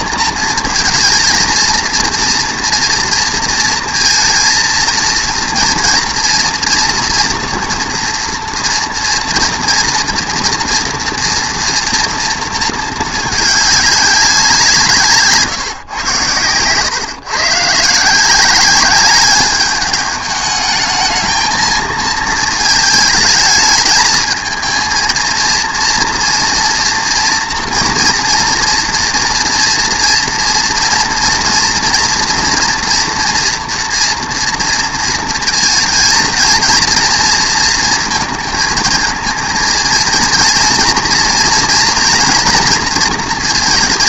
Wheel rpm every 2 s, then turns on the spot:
230, 230, 230, 230, 230, 240, 220, 170, 110, 190, 220, 220, 220, 230, 230, 230, 240, 230, 220, 220, 230, 230.
none